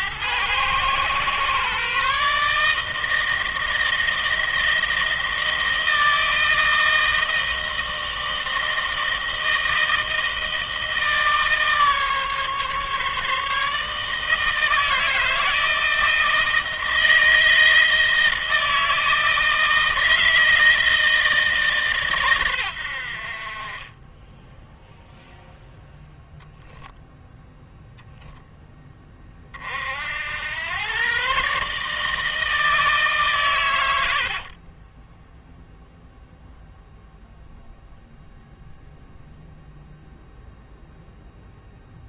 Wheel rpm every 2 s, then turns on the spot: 110, 150, 160, 160, 160, 160, 150, 160, 160, 160, 160, 100, 10, 0, 10, 100, 150, 40, 0, 0, 0.
34-36